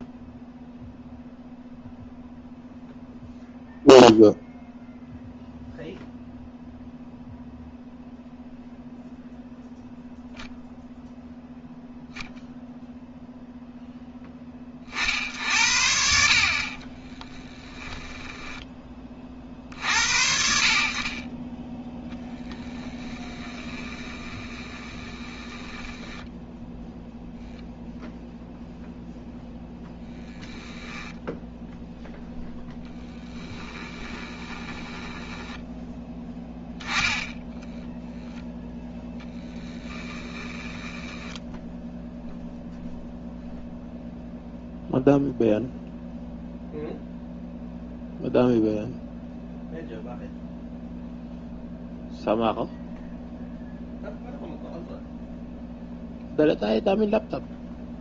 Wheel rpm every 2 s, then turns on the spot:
0, 0, 0, 0, 0, 0, 0, 40, 30, 20, 50, 10, 20, 0, 0, 0, 10, 10, 10, 0, 10, 0, 0, 0, 0, 0, 0, 0, 0.
16-18 22-26 34-36 40-42